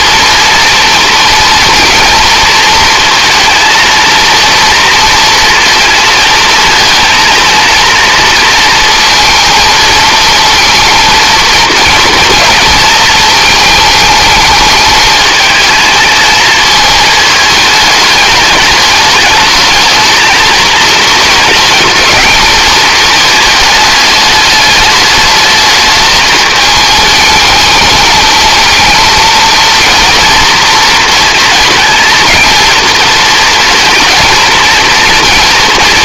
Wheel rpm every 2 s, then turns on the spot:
230, 230, 230, 220, 230, 230, 230, 220, 220, 210, 220, 220, 210, 220, 220, 230, 230, 230.
none